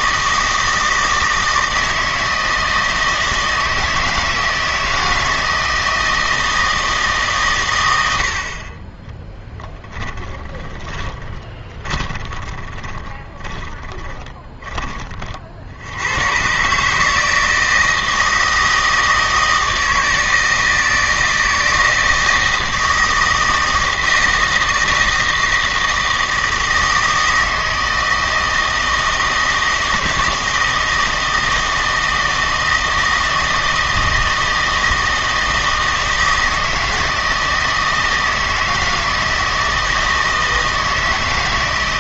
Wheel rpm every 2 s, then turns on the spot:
160, 160, 160, 160, 40, 10, 20, 20, 140, 160, 160, 160, 160, 160, 160, 160, 160, 160, 160, 160, 160.
10-14